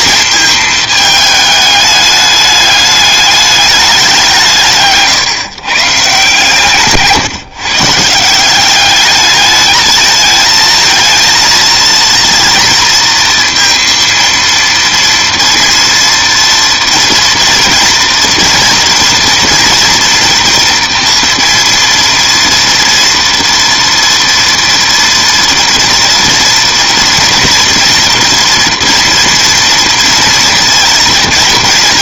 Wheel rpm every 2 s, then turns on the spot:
220, 210, 170, 150, 190, 220, 230, 230, 230, 230, 240, 230, 230, 240, 230, 230.
none